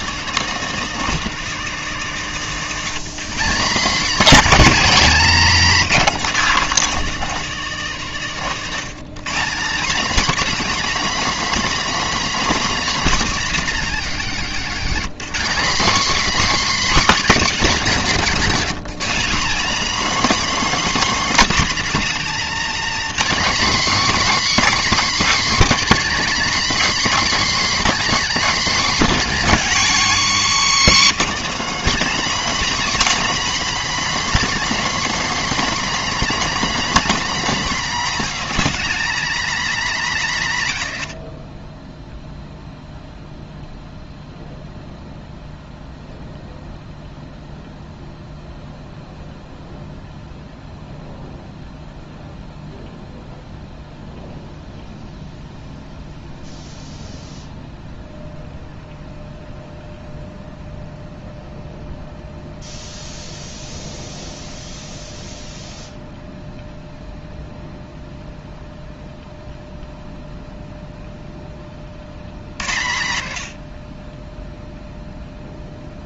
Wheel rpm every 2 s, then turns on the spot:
240, 210, 240, 240, 200, 290, 290, 240, 300, 230, 300, 270, 280, 240, 240, 220, 280, 250, 250, 270, 190, 0, 0, 0, 0, 0, 0, 0, 0, 0, 0, 0, 0, 0, 0, 0, 90, 0.
14-16 18-20